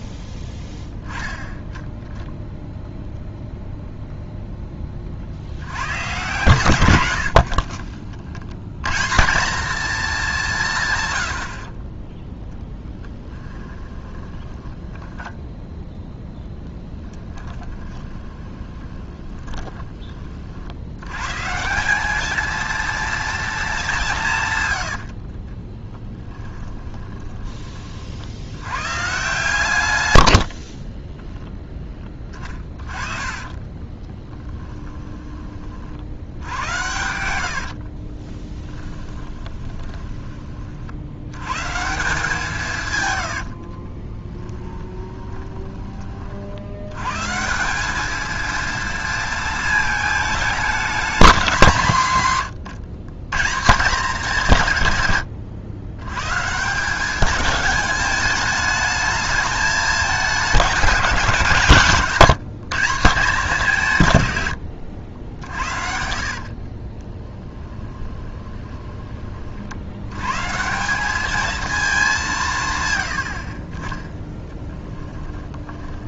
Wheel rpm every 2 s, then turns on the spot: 0, 0, 20, 110, 120, 170, 10, 10, 10, 20, 80, 230, 100, 20, 110, 20, 30, 20, 90, 10, 50, 140, 20, 90, 230, 210, 120, 150, 160, 210, 190, 160, 90, 40, 20, 170, 140, 10.
12-16 18-20 24-28 30-40 44-46 64-70 74-76